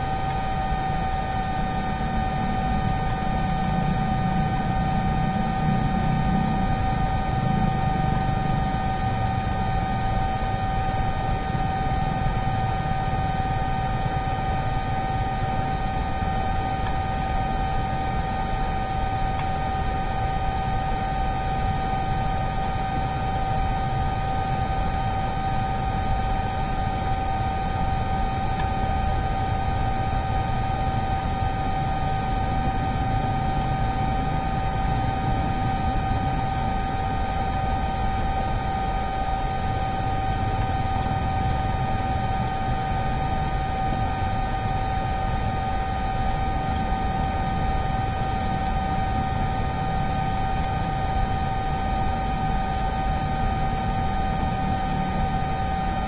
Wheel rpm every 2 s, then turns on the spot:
0, 0, 0, 0, 0, 0, 0, 0, 0, 0, 0, 0, 0, 0, 0, 0, 0, 0, 0, 0, 0, 0, 0, 0, 0, 0, 0, 0.
none